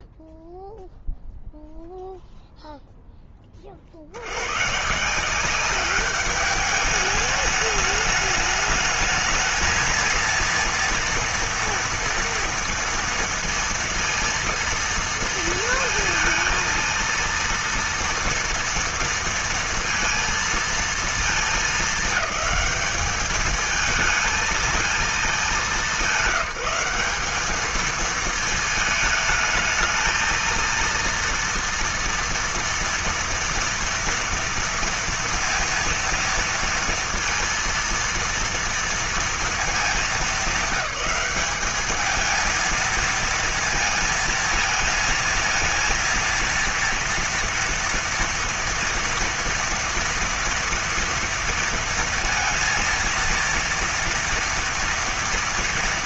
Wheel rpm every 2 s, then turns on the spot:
0, 0, 100, 200, 210, 230, 230, 230, 230, 230, 230, 210, 220, 190, 220, 230, 230, 230, 230, 230, 210, 220, 220, 230, 230, 230, 230, 230.
none